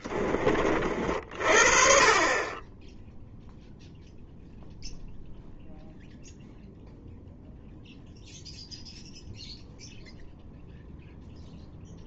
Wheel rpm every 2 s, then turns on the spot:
30, 20, 0, 0, 0, 0.
none